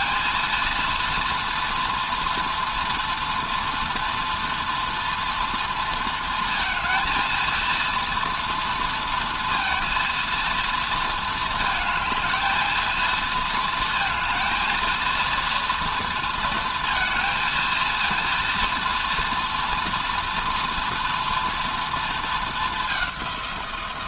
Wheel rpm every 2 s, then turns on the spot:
230, 230, 230, 230, 230, 230, 220, 220, 230, 230, 230, 210.
none